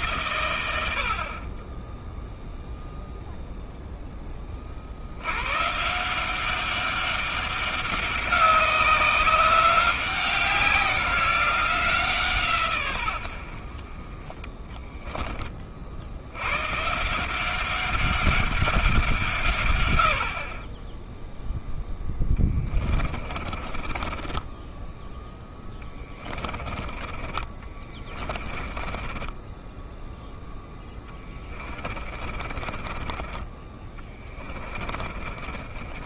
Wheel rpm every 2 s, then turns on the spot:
80, 0, 60, 200, 190, 180, 130, 10, 130, 190, 20, 30, 10, 20, 20, 10, 30, 30.
14-16 22-26 28-36